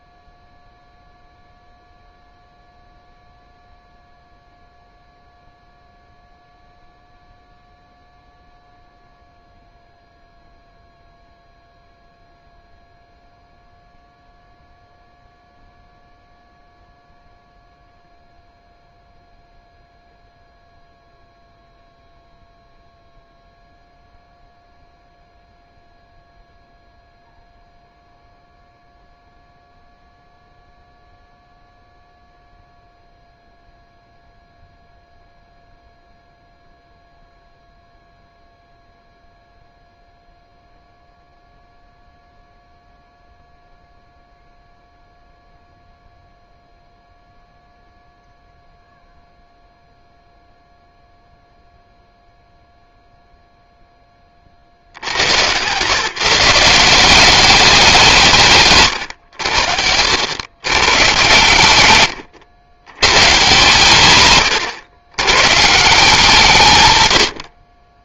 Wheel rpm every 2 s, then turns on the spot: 0, 0, 0, 0, 0, 0, 0, 0, 0, 0, 0, 0, 0, 0, 0, 0, 0, 0, 0, 0, 0, 0, 0, 0, 0, 0, 0, 60, 170, 130, 120, 110, 120, 130.
none